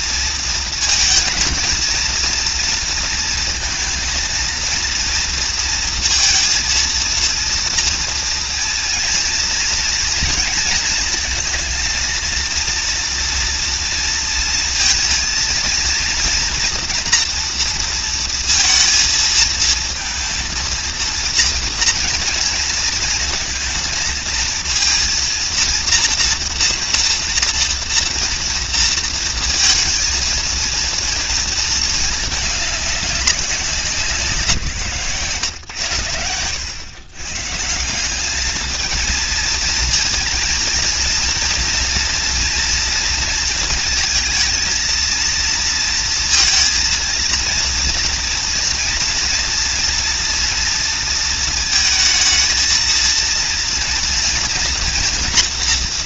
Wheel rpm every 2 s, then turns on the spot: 230, 230, 230, 230, 230, 230, 230, 230, 230, 230, 230, 230, 230, 230, 230, 230, 200, 140, 100, 220, 230, 230, 220, 230, 230, 230, 230, 230.
none